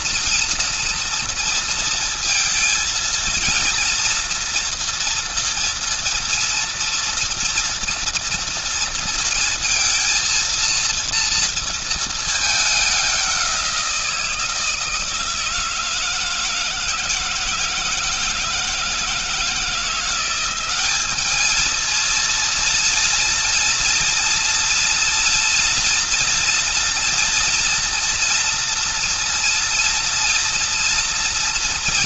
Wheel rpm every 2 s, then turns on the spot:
230, 230, 230, 230, 230, 230, 220, 170, 160, 160, 180, 230, 230, 240, 230, 230.
none